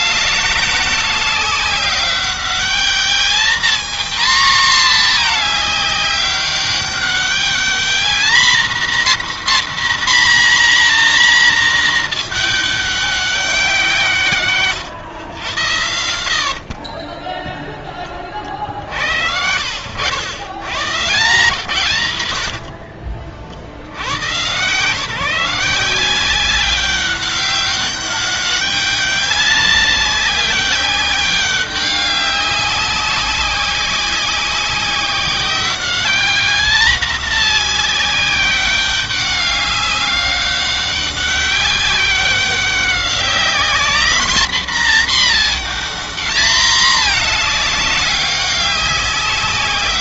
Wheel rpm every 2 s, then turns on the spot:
210, 200, 240, 200, 230, 250, 220, 130, 60, 50, 90, 100, 130, 190, 200, 190, 190, 190, 200, 190, 200, 190, 230, 230, 200.
14-18 22-24